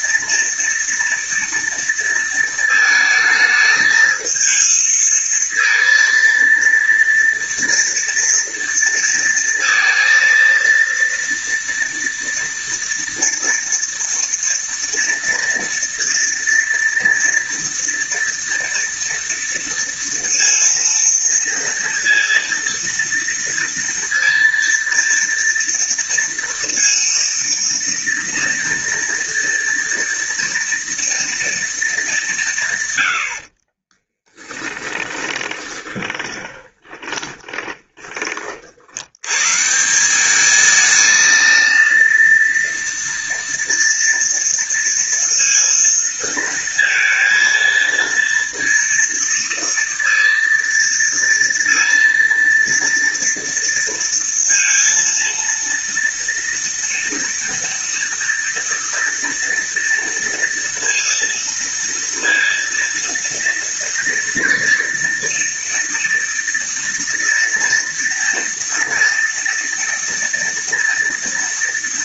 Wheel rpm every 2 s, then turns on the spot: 230, 220, 220, 230, 230, 230, 230, 230, 230, 230, 230, 230, 230, 230, 230, 230, 120, 20, 20, 80, 220, 230, 230, 230, 230, 230, 230, 230, 230, 230, 230, 230, 230, 230, 230, 230.
34-38